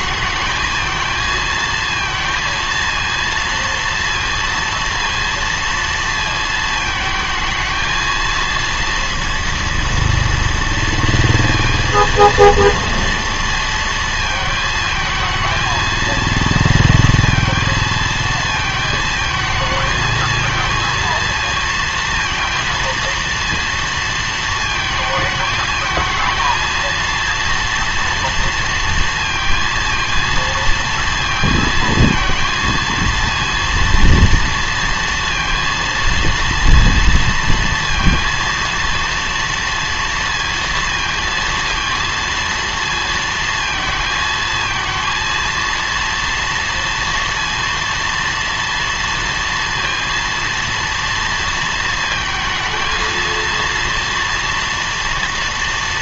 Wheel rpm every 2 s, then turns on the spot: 220, 230, 230, 220, 230, 230, 230, 220, 230, 230, 230, 230, 220, 230, 230, 230, 230, 230, 230, 230, 230, 230, 220, 230, 230, 230, 230, 240.
none